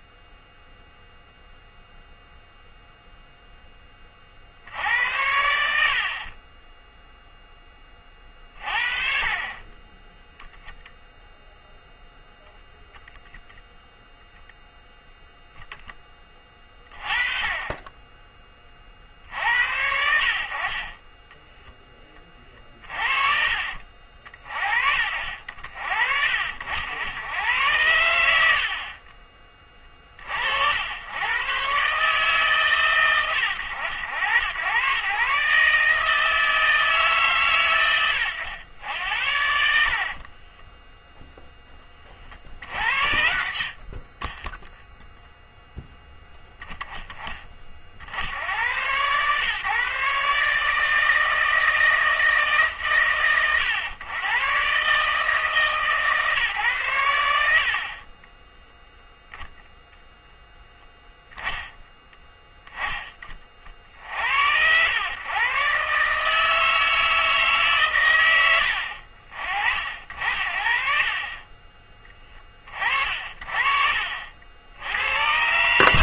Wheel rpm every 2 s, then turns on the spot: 0, 0, 70, 20, 40, 0, 0, 0, 20, 30, 40, 30, 50, 80, 60, 70, 130, 110, 160, 100, 10, 60, 10, 10, 100, 150, 140, 130, 130, 0, 10, 10, 90, 160, 80, 60, 30, 80.
6-8 40-42